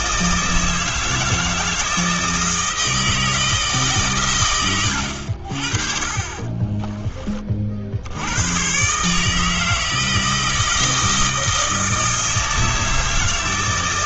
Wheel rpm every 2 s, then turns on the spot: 160, 160, 90, 20, 140, 160, 160.
6-8